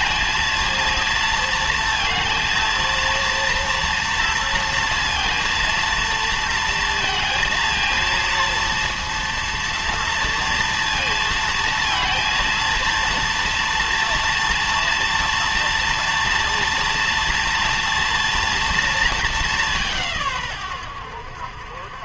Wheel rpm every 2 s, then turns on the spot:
230, 230, 230, 230, 230, 230, 230, 230, 230, 230, 100.
none